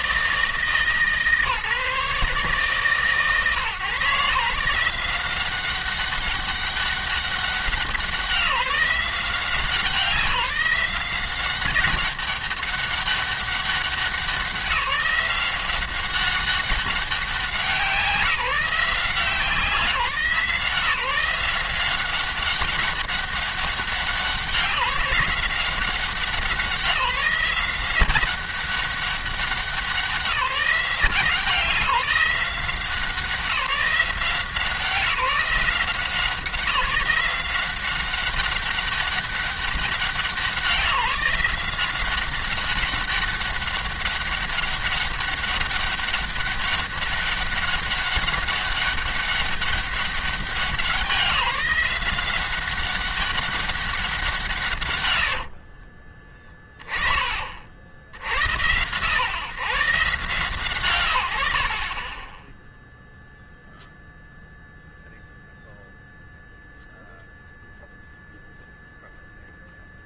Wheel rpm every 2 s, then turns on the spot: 150, 150, 170, 200, 180, 180, 200, 190, 190, 160, 160, 190, 180, 190, 190, 170, 180, 180, 180, 190, 180, 190, 200, 200, 200, 180, 190, 140, 30, 90, 110, 0, 0, 0, 0.
none